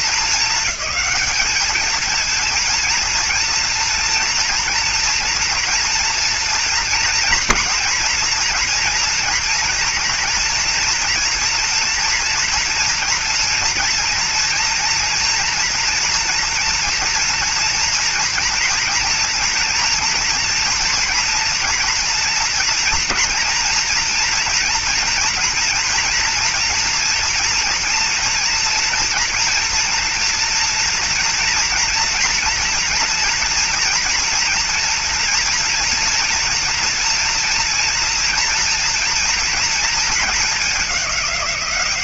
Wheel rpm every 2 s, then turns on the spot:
200, 230, 230, 240, 230, 230, 230, 240, 230, 230, 230, 230, 230, 230, 240, 240, 230, 230, 230, 230, 210.
none